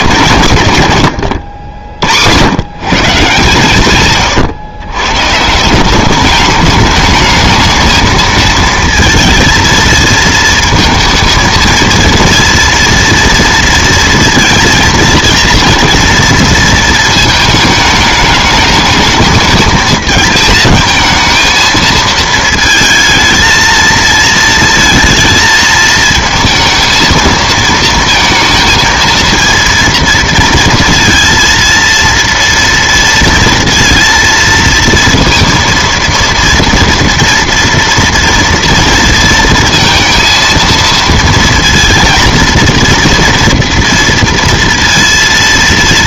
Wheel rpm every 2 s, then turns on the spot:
110, 140, 110, 200, 220, 230, 230, 230, 230, 210, 220, 220, 220, 220, 230, 230, 230, 230, 230, 230, 230, 230, 230.
none